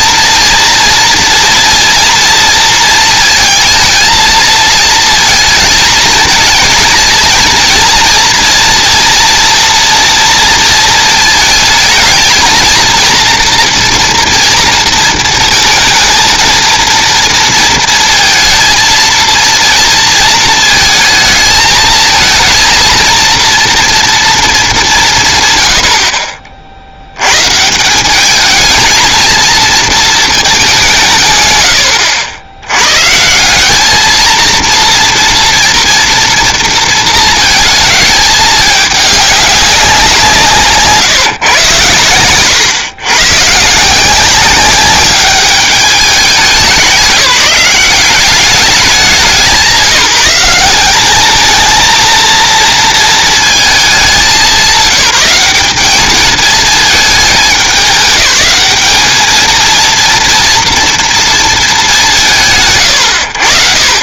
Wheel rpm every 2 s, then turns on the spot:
230, 230, 230, 230, 230, 230, 230, 230, 230, 230, 220, 230, 200, 60, 220, 220, 110, 230, 230, 210, 150, 130, 190, 200, 190, 180, 230, 180, 220, 210, 230, 100.
none